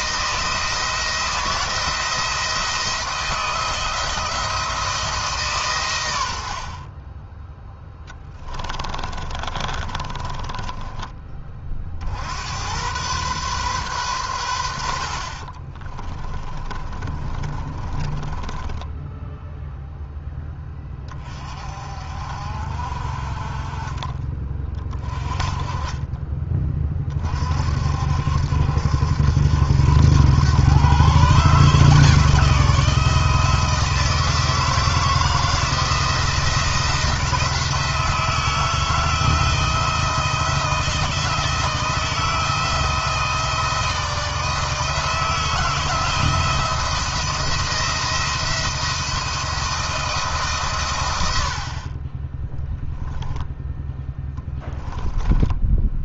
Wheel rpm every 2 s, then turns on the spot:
160, 160, 160, 40, 30, 30, 100, 80, 20, 10, 10, 50, 30, 30, 70, 120, 160, 160, 170, 160, 160, 160, 160, 170, 170, 130, 10, 20.
8-12 16-20 54-56